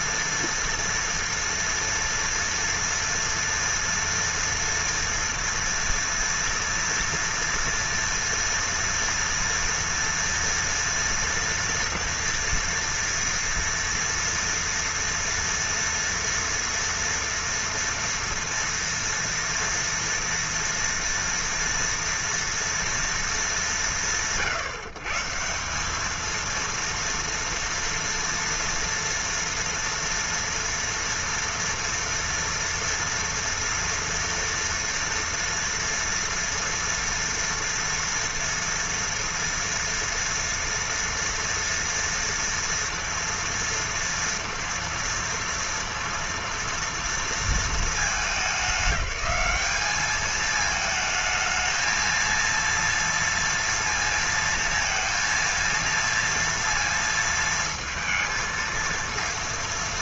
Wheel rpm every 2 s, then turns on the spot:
230, 230, 230, 230, 230, 230, 230, 230, 230, 230, 240, 230, 120, 220, 230, 240, 230, 230, 230, 230, 230, 230, 230, 230, 210, 220, 230, 230, 230, 230.
none